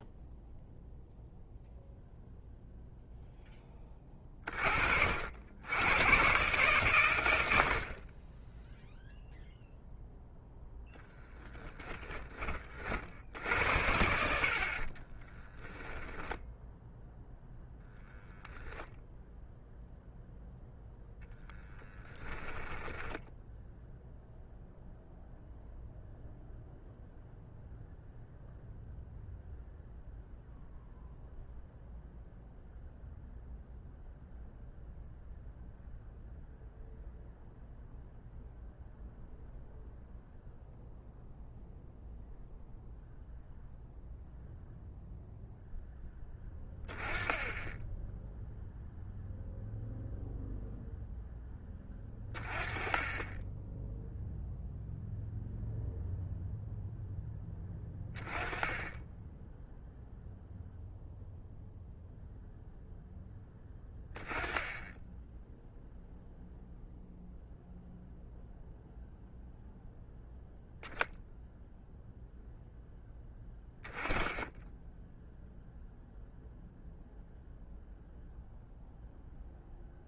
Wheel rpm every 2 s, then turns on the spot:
0, 0, 50, 120, 0, 10, 50, 30, 0, 0, 0, 10, 0, 0, 0, 0, 0, 0, 0, 0, 0, 0, 0, 10, 0, 0, 20, 0, 0, 10, 0, 0, 10, 0, 0, 0, 10, 10, 0, 0.
10-12 14-16